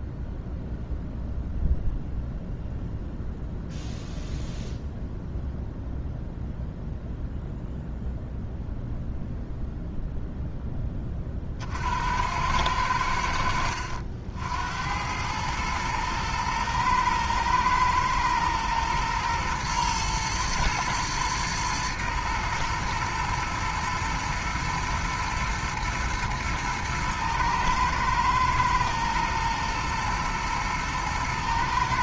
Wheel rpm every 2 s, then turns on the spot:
0, 0, 0, 0, 0, 10, 90, 80, 120, 120, 110, 120, 120, 110, 110, 110.
none